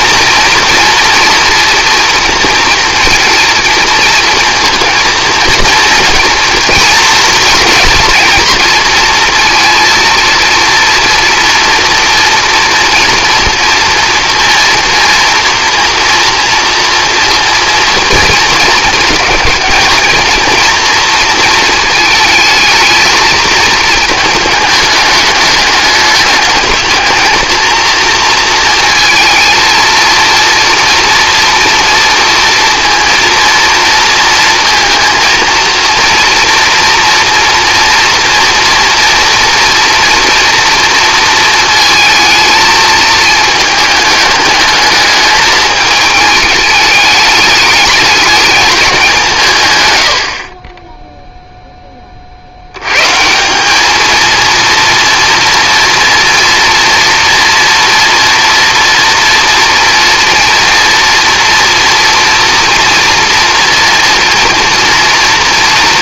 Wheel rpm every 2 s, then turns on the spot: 230, 230, 230, 230, 230, 230, 230, 230, 230, 220, 230, 220, 220, 220, 230, 230, 230, 230, 240, 240, 230, 220, 210, 220, 210, 20, 90, 230, 230, 230, 230, 230, 230.
none